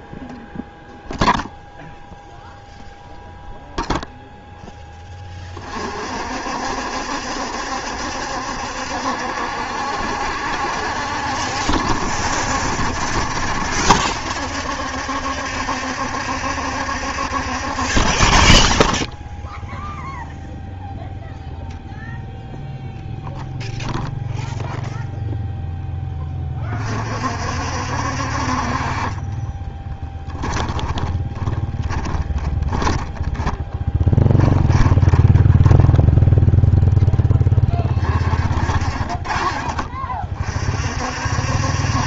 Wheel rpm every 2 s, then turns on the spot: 0, 0, 20, 70, 70, 70, 70, 70, 50, 0, 0, 0, 0, 40, 30, 30, 10, 20, 0, 40, 50.
30-34